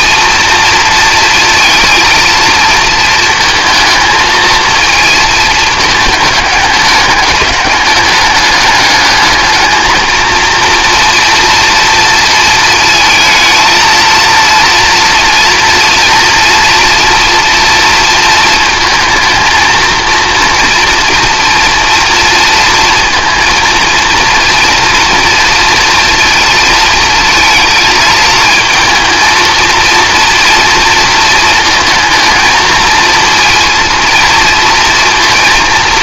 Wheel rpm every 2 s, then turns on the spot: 230, 230, 230, 210, 210, 230, 230, 230, 240, 230, 230, 230, 230, 230, 220, 230, 220, 230.
none